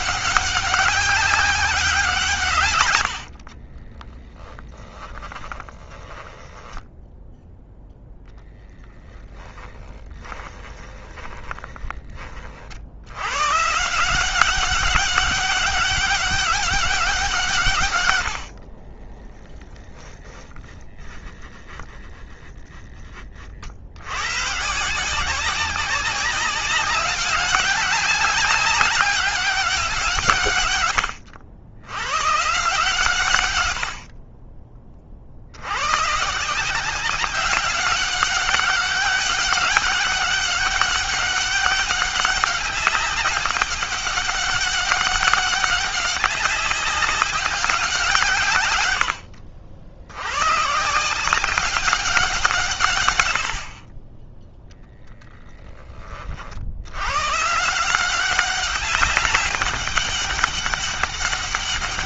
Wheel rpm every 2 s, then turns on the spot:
190, 110, 20, 10, 10, 30, 80, 200, 200, 50, 10, 20, 150, 190, 200, 120, 140, 40, 180, 200, 200, 200, 200, 200, 110, 150, 130, 0, 80, 200, 200.
2-12 18-20